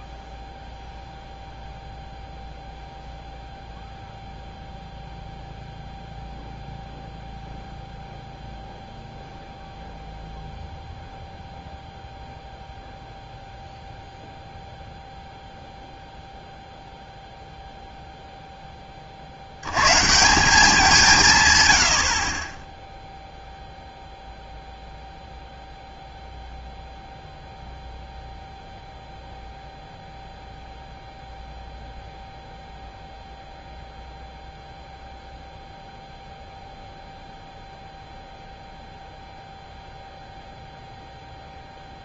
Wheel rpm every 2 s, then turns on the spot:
0, 0, 0, 0, 0, 0, 0, 0, 0, 10, 180, 20, 0, 0, 0, 0, 0, 0, 0, 0, 0.
22-24